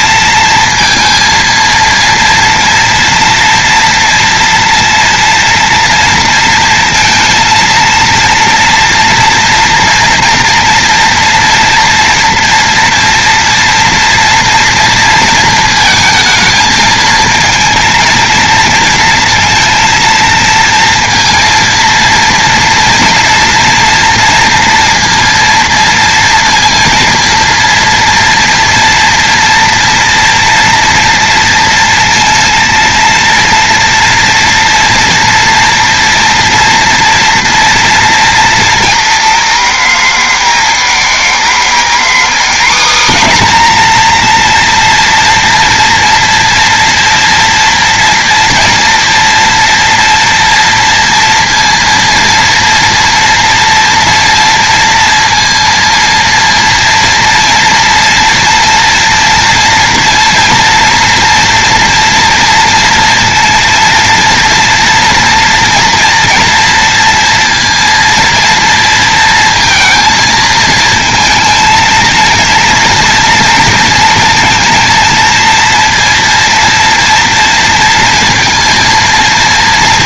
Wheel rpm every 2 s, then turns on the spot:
230, 230, 230, 230, 230, 230, 240, 230, 220, 230, 230, 230, 230, 230, 230, 230, 230, 230, 240, 230, 230, 250, 230, 230, 230, 230, 230, 230, 230, 230, 230, 230, 230, 230, 230, 230, 230, 230, 230, 230.
none